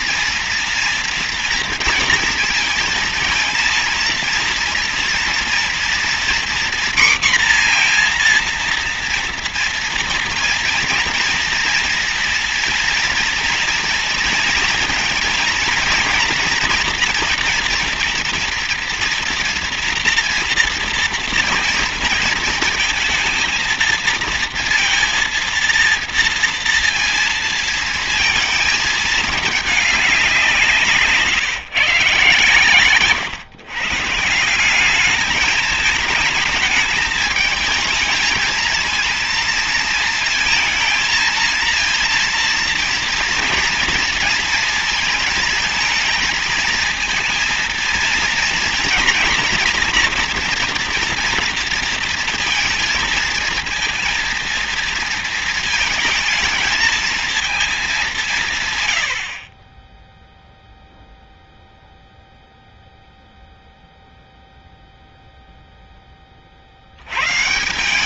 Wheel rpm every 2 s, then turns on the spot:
230, 230, 230, 240, 230, 230, 230, 240, 230, 230, 230, 220, 230, 230, 220, 180, 130, 170, 210, 220, 230, 230, 230, 230, 230, 230, 230, 230, 220, 140, 0, 0, 0, 50.
none